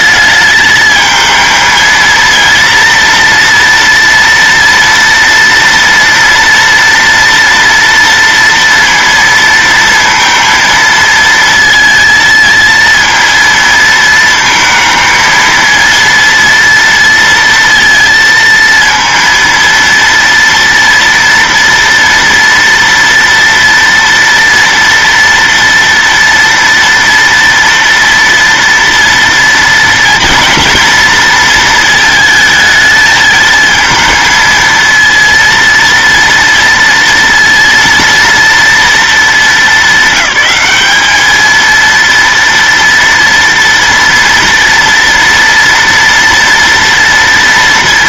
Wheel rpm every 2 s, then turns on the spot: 220, 230, 230, 230, 230, 230, 220, 220, 230, 230, 230, 230, 230, 230, 230, 230, 220, 230, 230, 230, 200, 230, 230, 230.
none